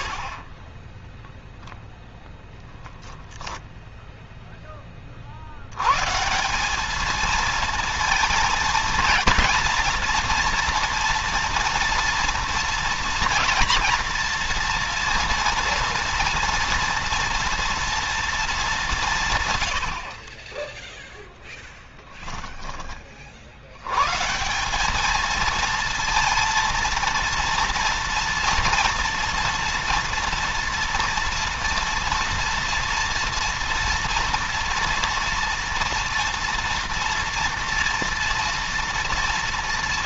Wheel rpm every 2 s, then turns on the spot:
0, 10, 30, 210, 220, 230, 230, 230, 230, 170, 0, 20, 190, 230, 230, 230, 230, 230, 230, 230.
none